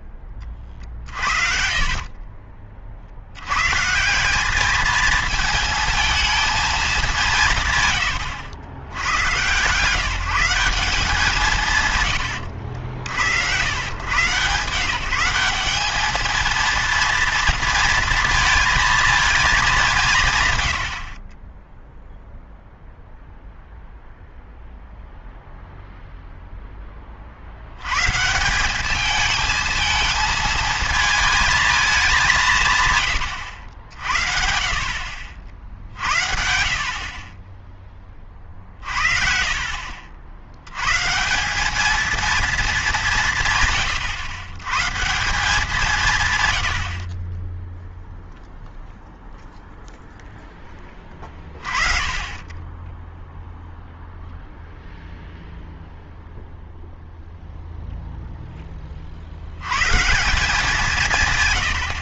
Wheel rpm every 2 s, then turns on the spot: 50, 40, 210, 220, 90, 190, 90, 150, 230, 230, 100, 0, 0, 10, 190, 220, 170, 60, 60, 50, 100, 220, 130, 100, 0, 20, 20, 0, 0, 20, 180.
0-2 20-22